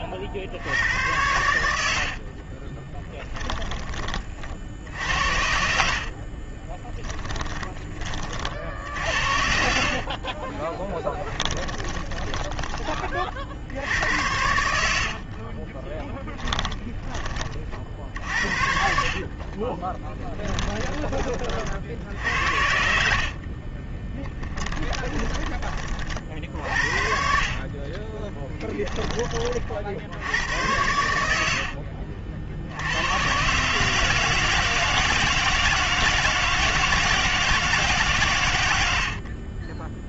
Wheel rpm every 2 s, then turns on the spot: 60, 50, 40, 30, 40, 30, 30, 80, 10, 60, 10, 70, 10, 50, 20, 80, 60, 160, 160, 120.
2-4 6-8 10-12 16-22 24-26 28-30